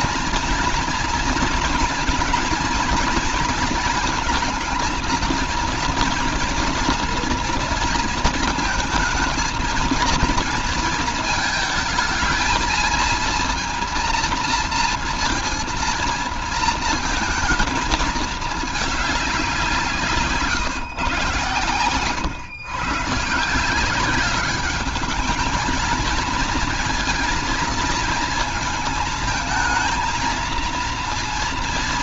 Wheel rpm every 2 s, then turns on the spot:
230, 230, 230, 240, 230, 230, 230, 230, 230, 200, 140, 150, 210, 230, 220, 230.
none